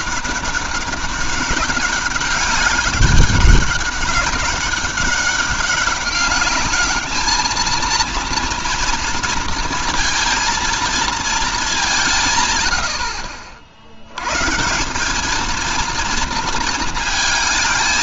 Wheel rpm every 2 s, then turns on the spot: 200, 190, 200, 210, 240, 230, 110, 160, 220.
none